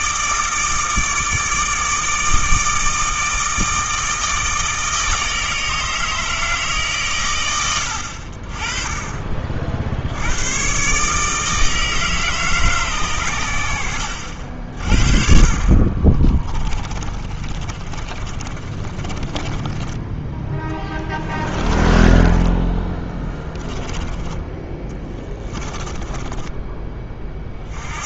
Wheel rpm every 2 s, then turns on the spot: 160, 160, 160, 130, 30, 140, 130, 40, 20, 30, 10, 20, 20, 20.
16-26